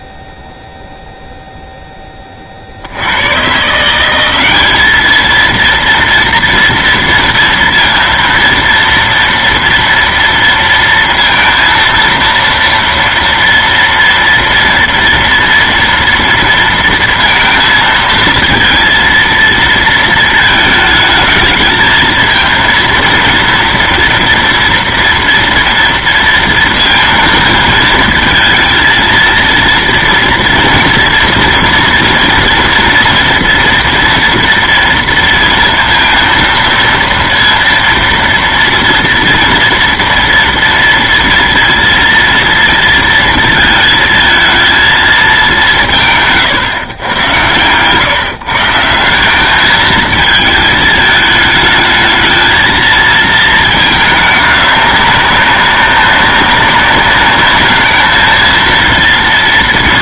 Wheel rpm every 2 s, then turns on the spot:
0, 10, 170, 230, 230, 230, 230, 230, 230, 230, 230, 220, 230, 230, 220, 230, 240, 230, 230, 240, 230, 230, 230, 160, 140, 220, 220, 210, 190, 220.
none